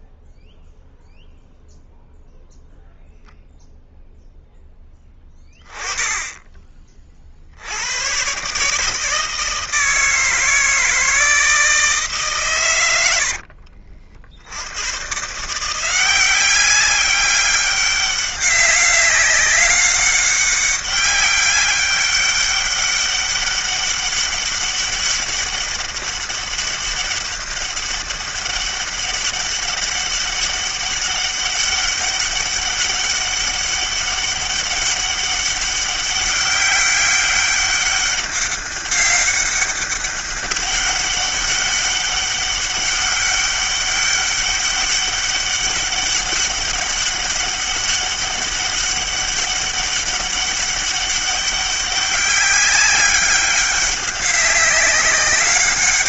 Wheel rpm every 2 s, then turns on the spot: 0, 0, 10, 30, 150, 160, 90, 100, 190, 200, 200, 200, 200, 200, 200, 200, 200, 200, 200, 200, 200, 200, 200, 200, 200, 200, 190, 190.
none